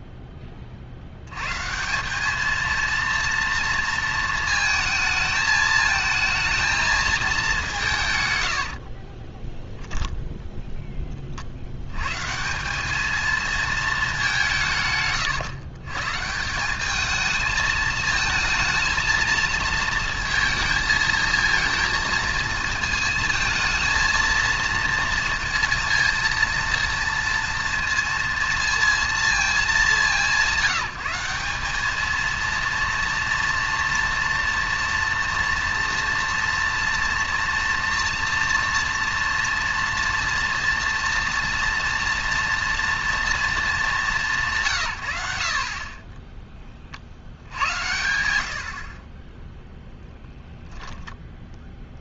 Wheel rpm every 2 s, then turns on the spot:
100, 230, 220, 210, 20, 20, 210, 130, 200, 220, 220, 230, 230, 230, 230, 170, 230, 240, 230, 240, 230, 230, 120, 10, 80, 0.
8-10